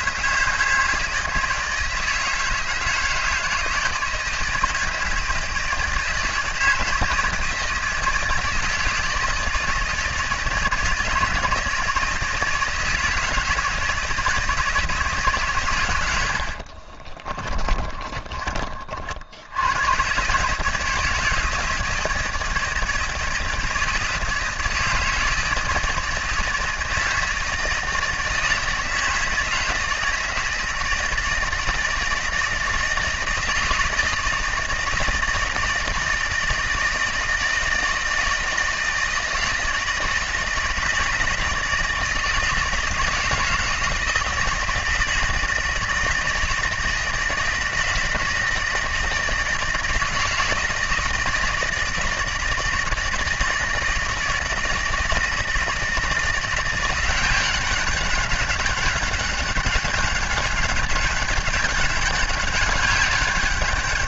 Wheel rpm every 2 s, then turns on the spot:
160, 160, 160, 160, 160, 160, 160, 160, 40, 40, 150, 160, 160, 160, 160, 160, 160, 160, 160, 160, 160, 160, 160, 160, 160, 160, 160, 160, 180, 200, 200, 200.
16-18